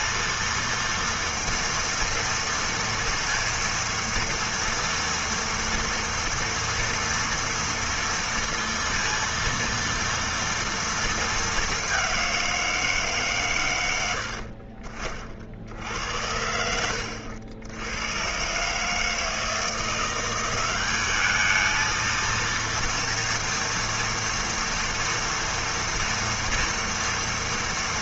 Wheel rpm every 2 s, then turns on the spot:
230, 230, 230, 230, 230, 230, 180, 70, 70, 130, 190, 230, 230, 230.
none